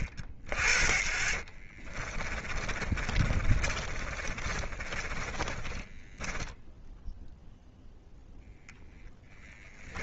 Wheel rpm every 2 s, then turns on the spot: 50, 30, 30, 10, 10.
2-8